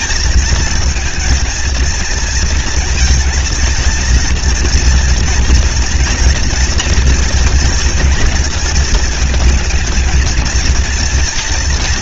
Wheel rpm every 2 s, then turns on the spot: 220, 230, 230, 230, 220, 230.
none